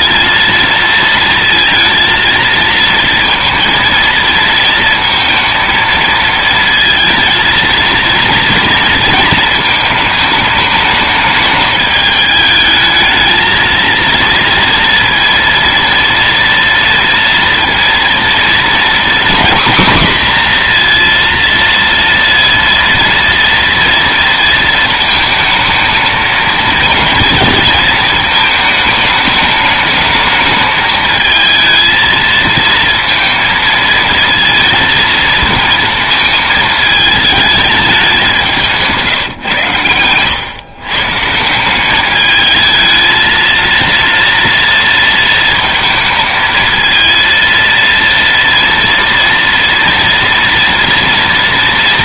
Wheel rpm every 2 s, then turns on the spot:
230, 230, 230, 230, 230, 210, 210, 230, 230, 230, 250, 230, 230, 220, 220, 220, 220, 230, 220, 180, 110, 210, 230, 220, 230, 230.
none